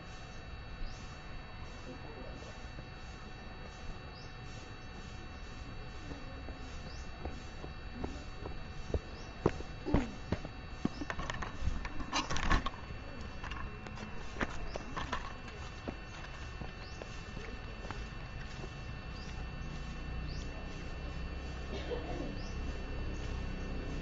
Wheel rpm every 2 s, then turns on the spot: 0, 0, 0, 0, 0, 0, 0, 0, 0, 0, 0, 0.
none